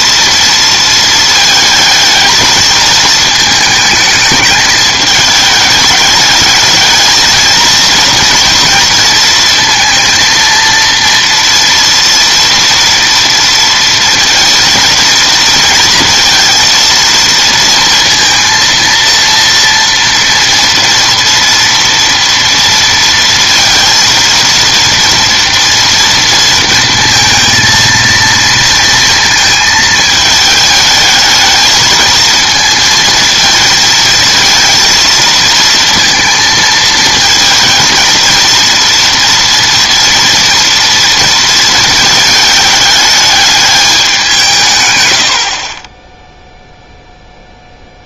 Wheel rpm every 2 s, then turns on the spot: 230, 220, 210, 220, 230, 230, 230, 230, 230, 230, 230, 230, 230, 230, 230, 220, 220, 230, 230, 230, 240, 220, 150, 0.
none